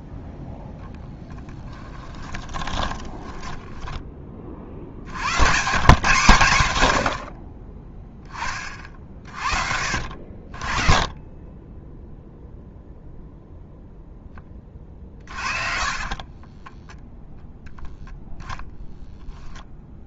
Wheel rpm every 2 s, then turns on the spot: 0, 20, 60, 100, 40, 40, 0, 30, 10, 0.
2-4 14-18